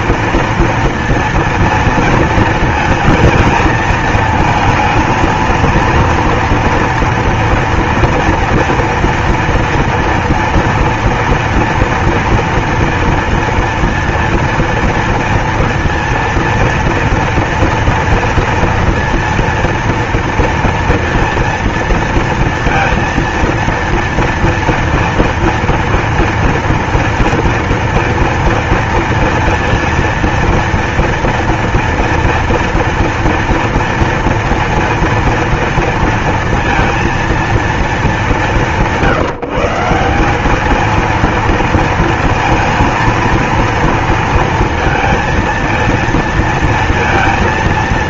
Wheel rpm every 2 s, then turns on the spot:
230, 230, 230, 230, 240, 240, 230, 230, 230, 230, 230, 230, 230, 230, 230, 230, 230, 230, 230, 170, 200, 230, 230, 230.
none